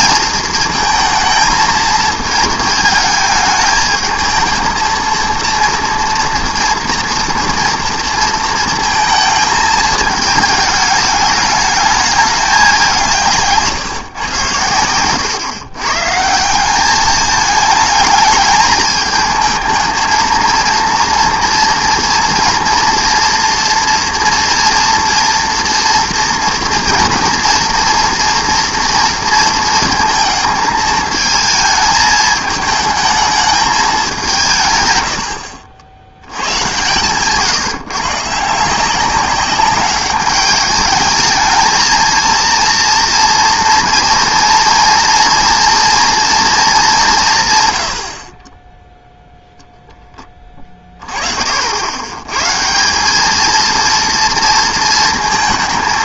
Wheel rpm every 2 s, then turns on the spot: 230, 220, 230, 230, 220, 210, 190, 110, 180, 210, 230, 230, 230, 230, 230, 220, 220, 130, 120, 170, 210, 230, 230, 210, 10, 20, 170, 230.
none